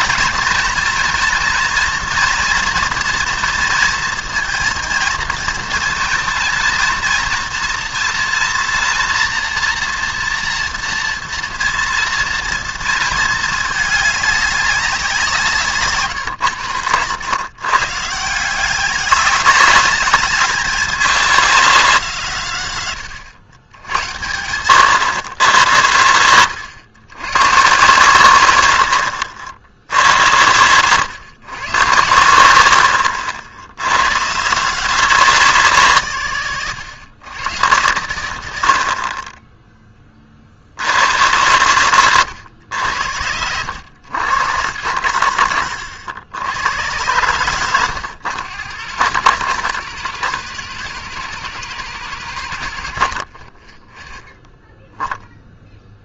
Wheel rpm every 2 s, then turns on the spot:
220, 230, 230, 230, 230, 230, 230, 200, 120, 190, 220, 150, 100, 110, 90, 100, 90, 160, 140, 70, 60, 90, 120, 100, 120, 160, 110, 0.
none